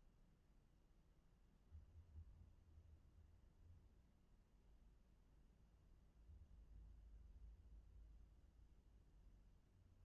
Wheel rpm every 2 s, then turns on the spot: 0, 0, 0, 0, 0.
none